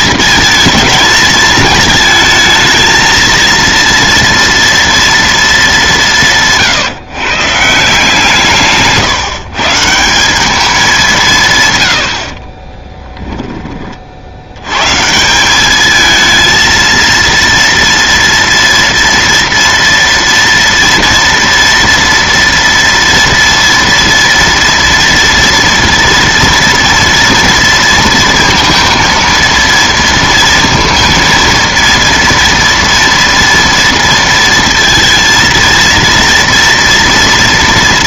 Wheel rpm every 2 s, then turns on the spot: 220, 220, 230, 150, 160, 200, 30, 100, 230, 230, 230, 230, 230, 230, 230, 230, 230, 230, 230.
12-14